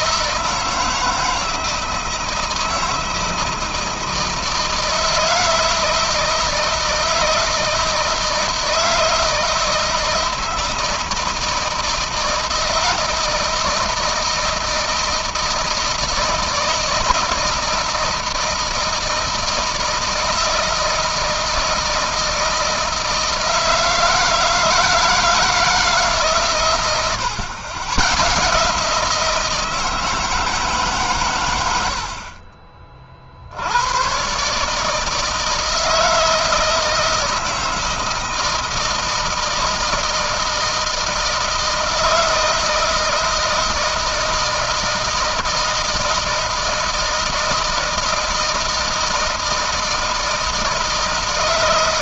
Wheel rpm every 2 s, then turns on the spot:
160, 160, 160, 160, 160, 160, 160, 160, 160, 170, 160, 160, 160, 130, 150, 160, 50, 140, 160, 160, 160, 160, 160, 160, 160, 160.
none